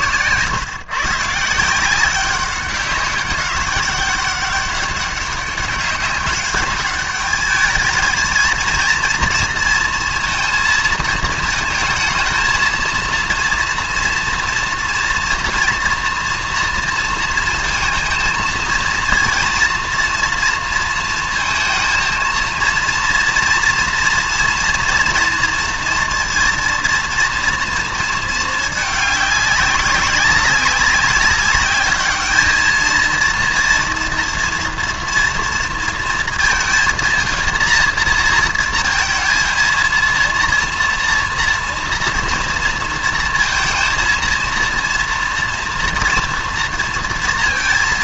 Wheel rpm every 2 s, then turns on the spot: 130, 190, 200, 200, 230, 230, 230, 230, 230, 230, 230, 230, 230, 230, 210, 200, 220, 230, 230, 230, 230, 230, 230, 230.
none